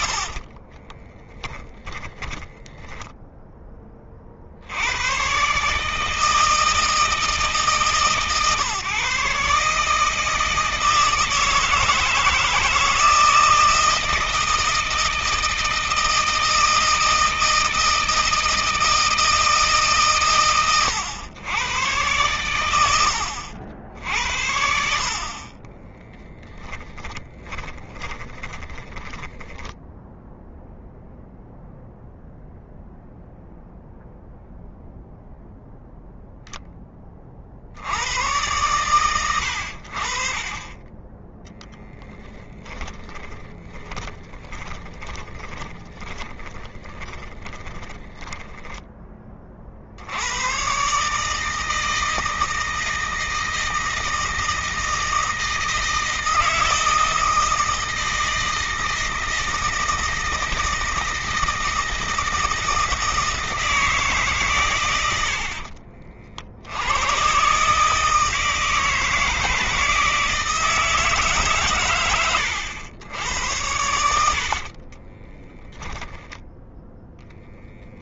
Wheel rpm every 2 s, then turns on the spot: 30, 10, 90, 160, 130, 160, 160, 160, 160, 160, 100, 90, 60, 10, 20, 0, 0, 0, 20, 110, 20, 40, 10, 20, 10, 140, 160, 160, 160, 160, 160, 160, 100, 90, 160, 150, 90, 30, 0.
0-4 26-30 42-48 74-76